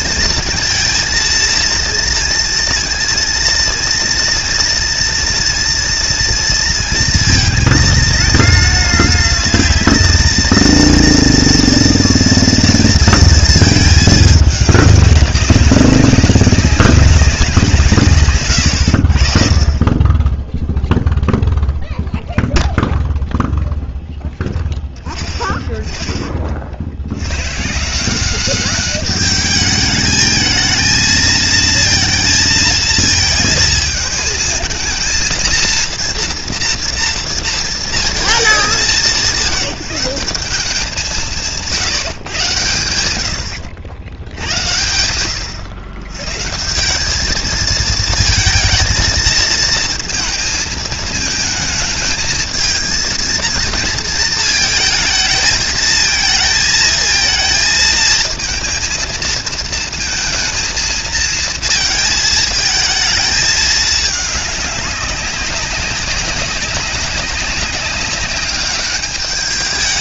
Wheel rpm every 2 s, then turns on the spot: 230, 230, 230, 230, 230, 230, 230, 200, 200, 120, 0, 0, 0, 50, 190, 220, 230, 220, 230, 210, 190, 120, 80, 150, 220, 220, 220, 230, 230, 220, 230, 220, 210, 190, 200.
18-20